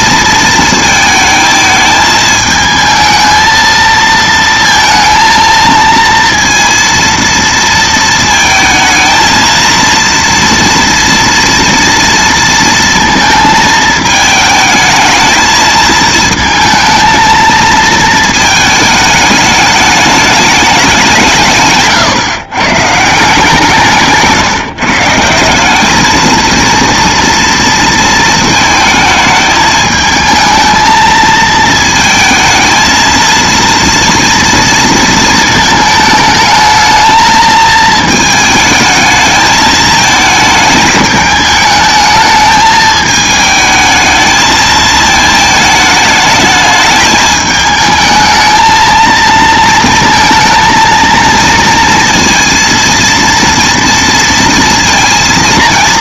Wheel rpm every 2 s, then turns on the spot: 220, 220, 230, 230, 220, 230, 230, 220, 220, 220, 200, 150, 160, 230, 220, 220, 220, 230, 220, 220, 210, 220, 220, 220, 220, 230, 230, 230.
none